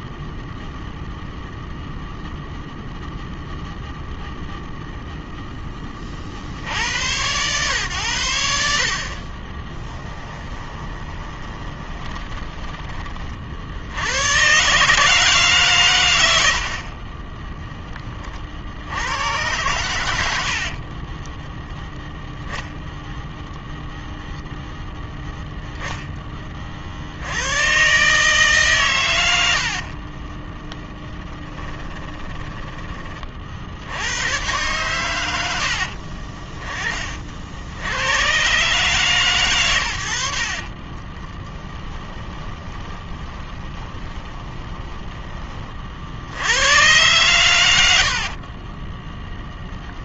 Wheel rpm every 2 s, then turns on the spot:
0, 0, 0, 80, 50, 20, 30, 150, 40, 90, 30, 0, 0, 70, 120, 10, 20, 110, 40, 140, 30, 20, 10, 110, 10.
10-12 16-18 20-22 30-32 40-46 48-50